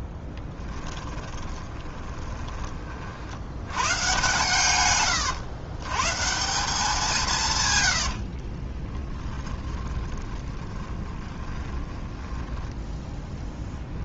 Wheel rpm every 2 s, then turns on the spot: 20, 20, 130, 170, 40, 10, 10.
0-2 8-12